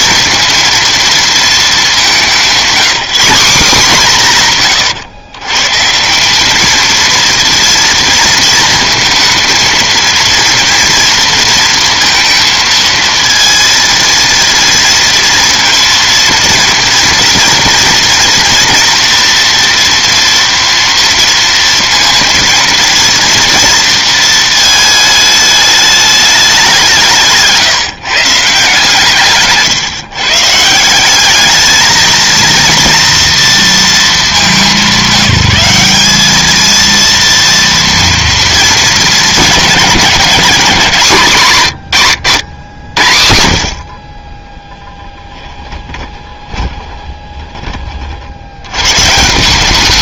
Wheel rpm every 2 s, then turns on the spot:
230, 200, 160, 200, 220, 230, 220, 230, 230, 230, 230, 230, 230, 200, 140, 140, 230, 210, 210, 220, 200, 110, 20, 20, 70.
46-48